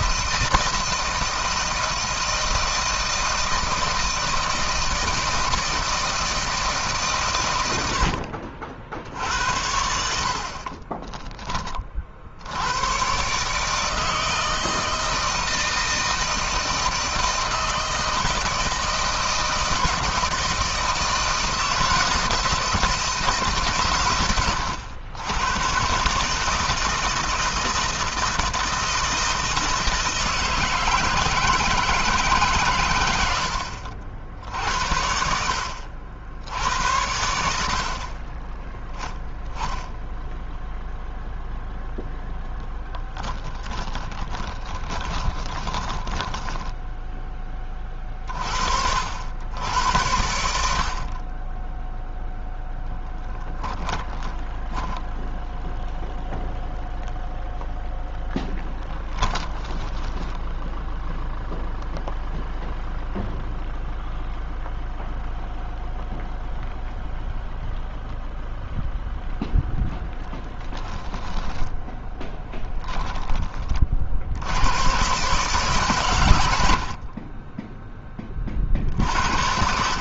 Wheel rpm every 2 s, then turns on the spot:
160, 160, 160, 150, 70, 30, 100, 160, 170, 160, 160, 160, 100, 160, 160, 160, 130, 70, 80, 20, 0, 10, 30, 10, 50, 70, 0, 10, 0, 20, 0, 0, 0, 0, 0, 10, 10, 90, 70, 30.
10-12 44-48 54-56 58-60 70-72